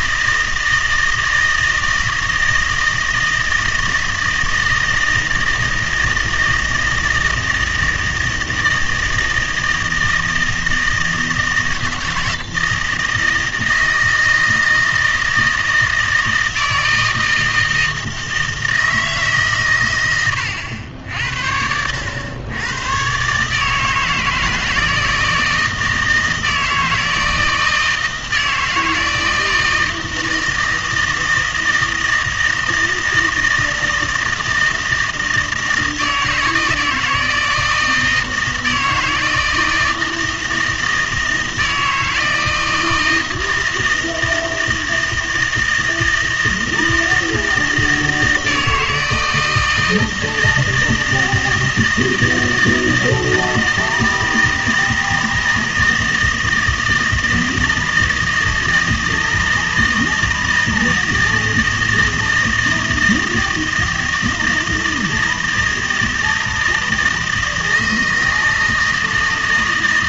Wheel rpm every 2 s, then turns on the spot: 160, 160, 160, 160, 160, 160, 160, 160, 160, 160, 80, 110, 160, 160, 160, 160, 160, 160, 160, 160, 160, 160, 160, 160, 160, 160, 160, 160, 160, 160, 160, 160, 160, 160, 160.
none